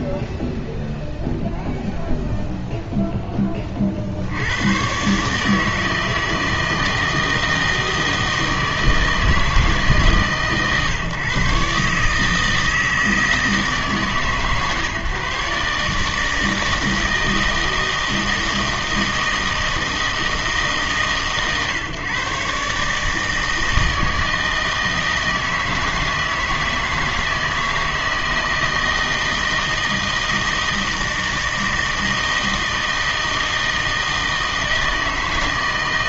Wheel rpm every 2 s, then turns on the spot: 0, 0, 100, 160, 160, 140, 160, 150, 160, 160, 150, 140, 160, 160, 160, 160, 160, 160.
none